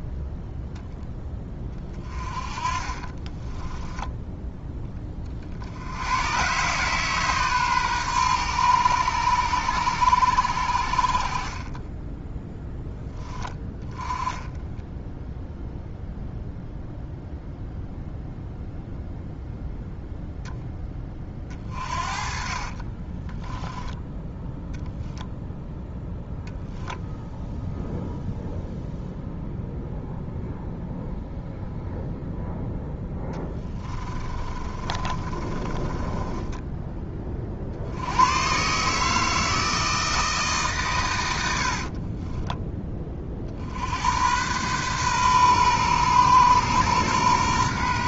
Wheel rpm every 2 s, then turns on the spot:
0, 30, 10, 140, 110, 70, 10, 10, 0, 0, 20, 20, 0, 0, 0, 0, 10, 30, 10, 140, 130, 20, 120, 120.
2-4 22-24 34-36